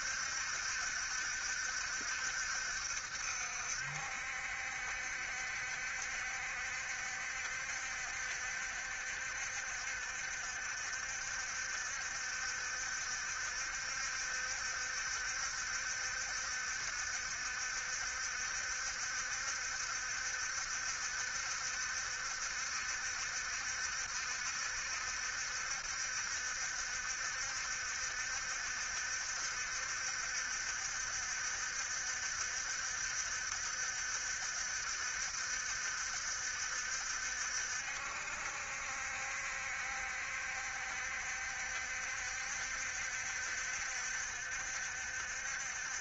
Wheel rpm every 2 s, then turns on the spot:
70, 70, 70, 70, 70, 60, 70, 70, 70, 70, 70, 70, 70, 70, 70, 70, 70, 70, 70, 70, 70, 70, 70.
none